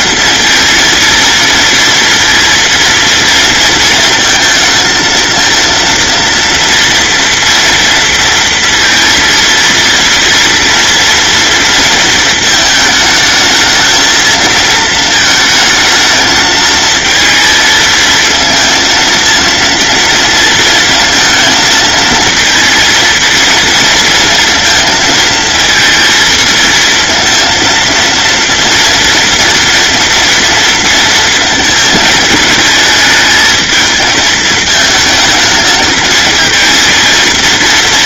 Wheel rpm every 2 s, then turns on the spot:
230, 230, 220, 230, 230, 230, 220, 220, 220, 230, 230, 230, 230, 230, 230, 230, 220, 220, 230.
none